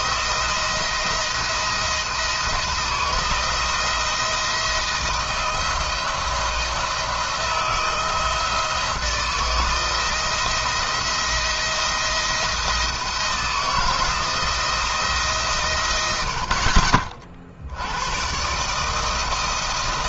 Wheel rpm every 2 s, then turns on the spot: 170, 160, 170, 170, 170, 170, 170, 170, 60, 140.
none